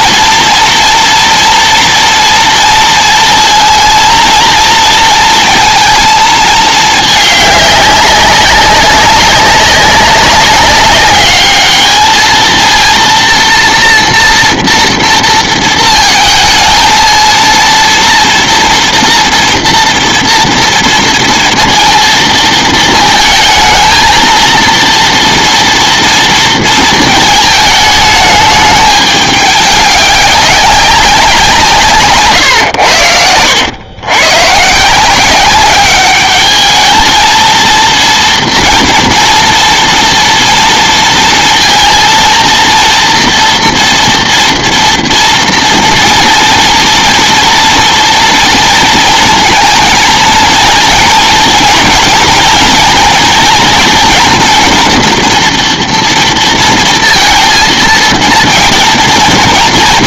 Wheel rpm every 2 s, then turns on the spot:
230, 230, 230, 220, 190, 200, 230, 230, 220, 230, 230, 230, 230, 230, 210, 200, 110, 150, 220, 230, 230, 230, 230, 230, 230, 230, 230, 230, 230, 230.
none